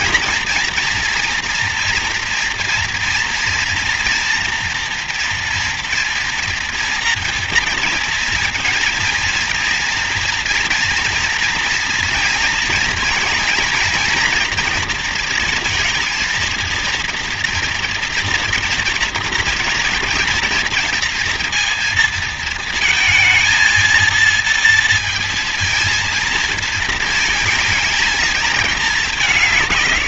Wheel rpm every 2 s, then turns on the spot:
230, 230, 240, 230, 230, 230, 230, 230, 230, 230, 230, 230, 230, 230, 220.
none